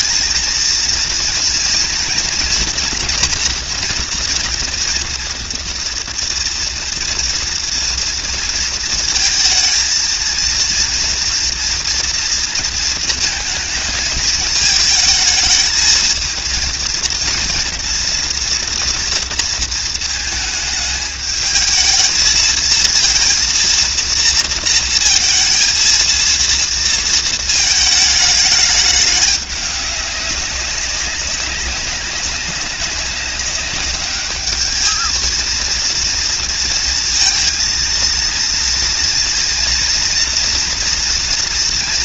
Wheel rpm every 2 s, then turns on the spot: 230, 240, 230, 240, 230, 230, 230, 220, 230, 230, 220, 230, 230, 230, 210, 200, 200, 220, 230, 230, 230.
none